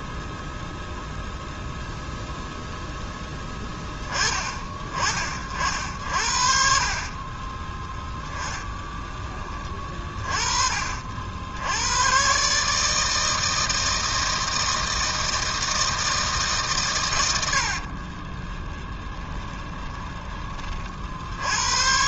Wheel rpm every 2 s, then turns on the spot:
0, 0, 40, 40, 10, 50, 150, 160, 140, 20, 40.
8-10 18-20